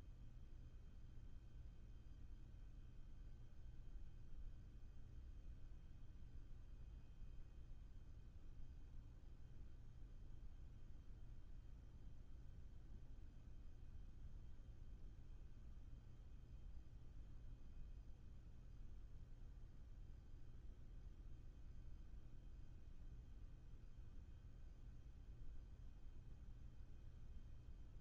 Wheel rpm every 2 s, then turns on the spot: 0, 0, 0, 0, 0, 0, 0, 0, 0, 0, 0, 0, 0, 0.
none